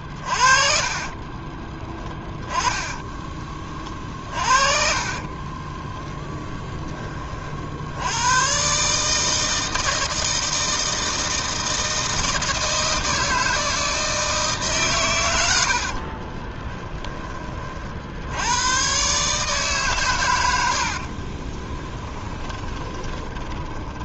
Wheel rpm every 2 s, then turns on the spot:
40, 10, 40, 10, 140, 160, 160, 140, 10, 120, 70, 10.
0-6 16-18 20-24